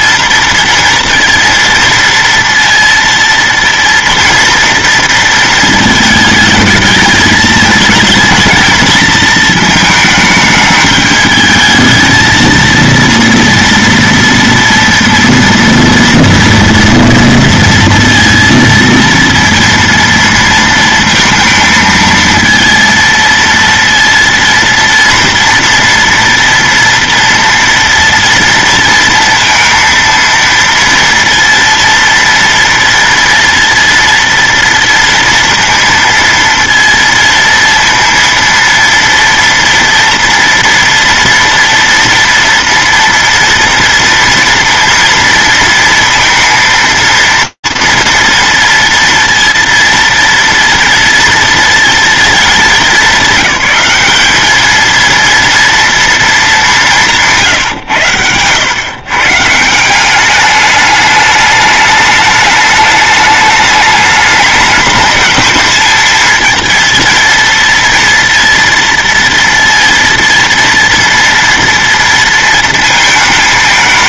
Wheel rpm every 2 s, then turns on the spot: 230, 230, 230, 220, 220, 210, 230, 230, 230, 230, 230, 230, 230, 230, 230, 230, 230, 230, 230, 230, 230, 230, 230, 230, 230, 230, 230, 210, 230, 130, 180, 210, 210, 220, 230, 230, 230.
none